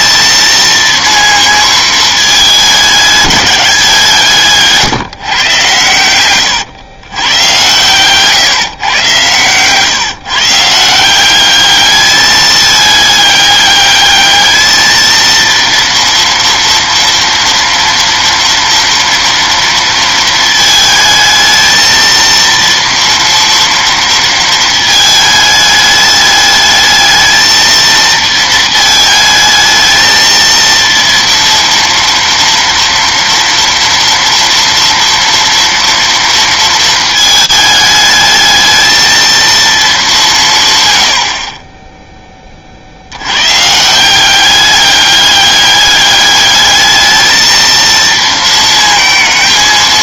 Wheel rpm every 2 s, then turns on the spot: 230, 210, 150, 110, 130, 170, 210, 220, 230, 230, 220, 230, 220, 220, 220, 230, 230, 230, 220, 220, 100, 50, 200, 210, 230.
none